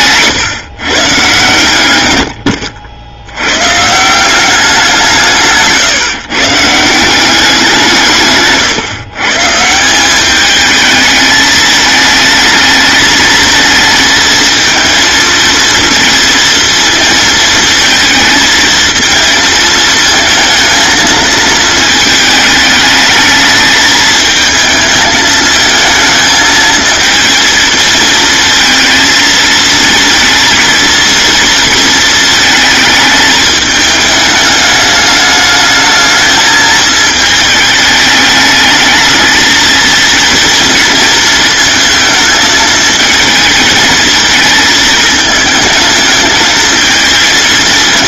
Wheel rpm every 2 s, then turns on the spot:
130, 70, 180, 170, 140, 210, 220, 230, 230, 220, 230, 220, 220, 220, 220, 230, 220, 210, 220, 220, 230, 220, 230, 220.
none